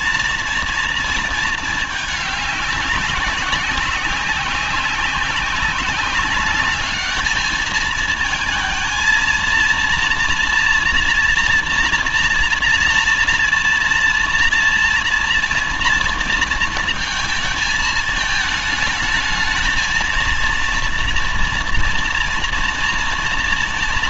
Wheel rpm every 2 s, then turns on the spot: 230, 200, 190, 210, 230, 230, 230, 230, 220, 210, 230, 240.
none